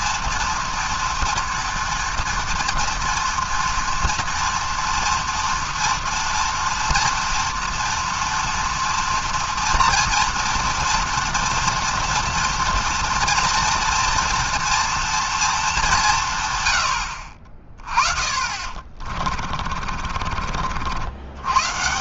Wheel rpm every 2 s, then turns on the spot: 230, 240, 240, 230, 230, 230, 230, 230, 100, 30, 70.
18-20